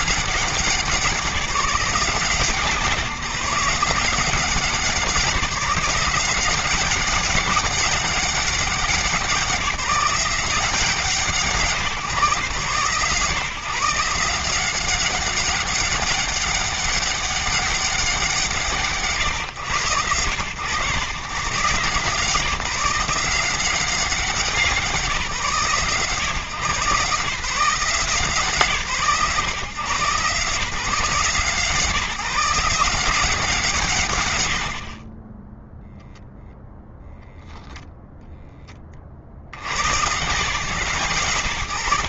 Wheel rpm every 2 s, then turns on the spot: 190, 160, 170, 180, 190, 180, 140, 170, 200, 180, 100, 160, 190, 140, 150, 150, 160, 130, 0, 10, 140.
none